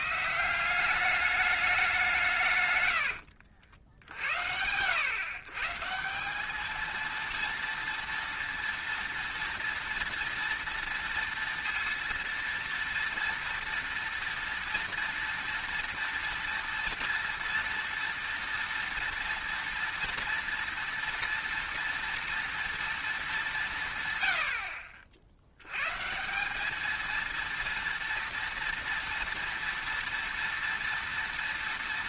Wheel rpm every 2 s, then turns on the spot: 180, 120, 80, 220, 230, 230, 230, 230, 230, 230, 230, 230, 60, 200, 230, 230.
none